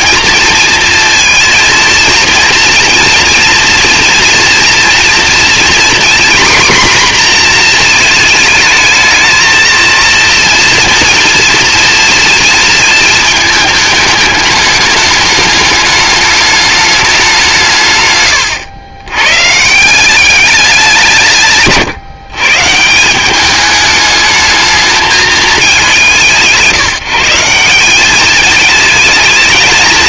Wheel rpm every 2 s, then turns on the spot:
230, 230, 230, 260, 220, 230, 230, 210, 210, 110, 190, 160, 210, 150, 220.
none